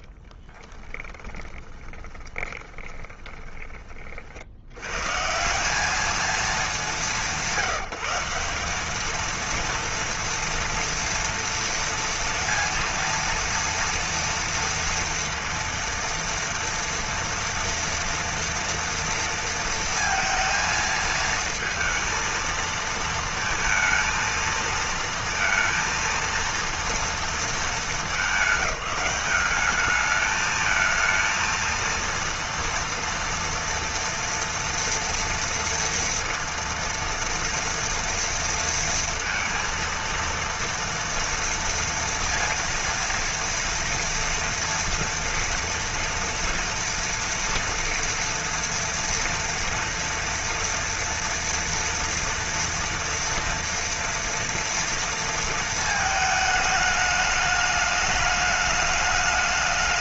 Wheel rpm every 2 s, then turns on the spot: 20, 20, 70, 220, 180, 230, 230, 230, 230, 230, 220, 220, 230, 230, 210, 210, 230, 230, 230, 230, 230, 230, 230, 230, 230, 230, 230, 230, 220, 210.
0-4